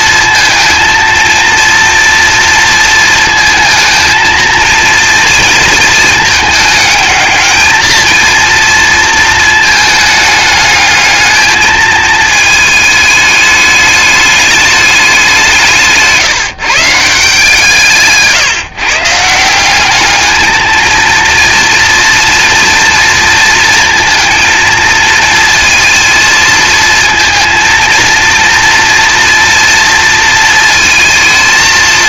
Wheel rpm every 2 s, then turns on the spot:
230, 230, 230, 210, 230, 210, 220, 210, 150, 140, 220, 230, 230, 220, 230, 230.
none